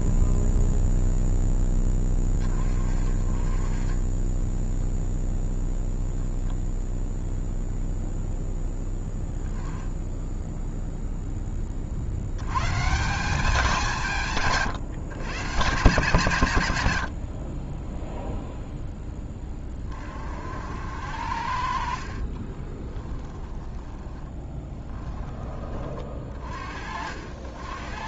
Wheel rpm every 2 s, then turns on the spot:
0, 20, 0, 0, 0, 0, 120, 140, 120, 0, 70, 30, 10, 40.
22-26